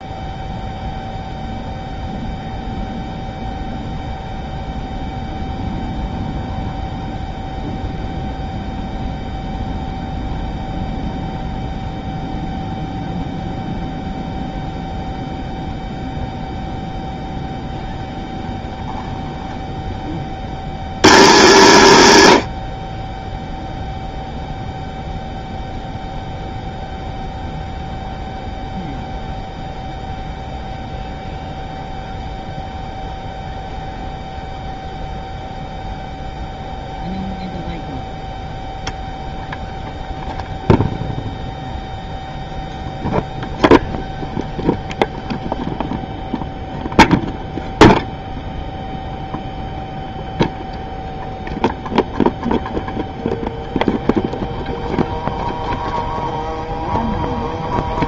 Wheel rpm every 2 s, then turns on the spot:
0, 0, 0, 0, 0, 0, 0, 0, 0, 0, 100, 30, 0, 0, 0, 0, 0, 0, 0, 0, 0, 0, 0, 0, 0, 0, 0, 0, 0.
none